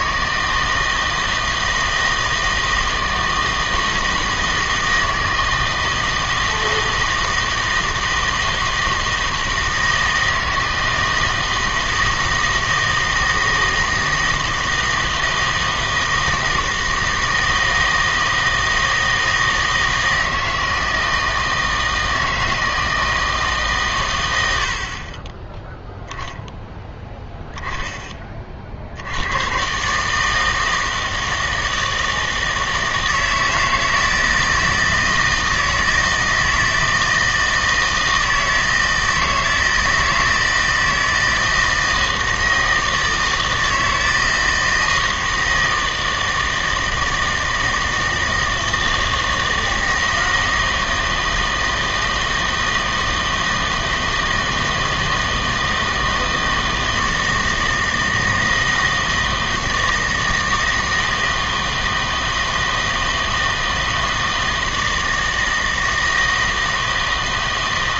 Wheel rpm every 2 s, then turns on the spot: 160, 160, 160, 160, 160, 160, 160, 160, 160, 160, 160, 160, 60, 10, 60, 160, 160, 160, 160, 160, 160, 160, 160, 160, 160, 160, 160, 160, 160, 160, 160, 160, 160, 160.
none